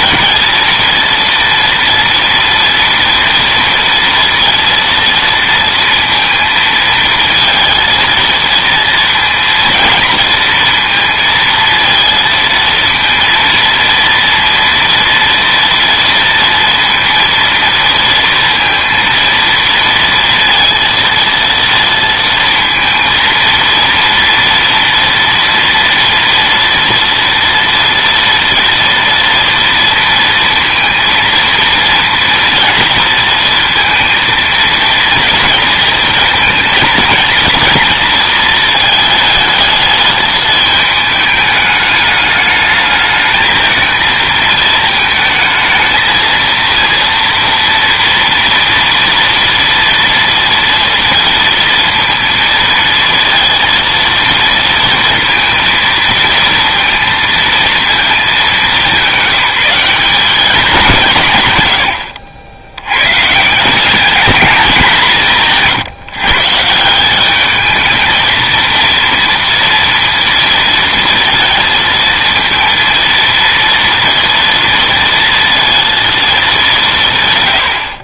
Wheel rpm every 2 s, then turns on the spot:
230, 230, 230, 220, 230, 230, 230, 230, 230, 230, 230, 230, 230, 230, 240, 230, 230, 230, 230, 220, 220, 210, 220, 230, 230, 230, 230, 230, 230, 200, 190, 100, 190, 160, 230, 230, 230, 230, 180.
none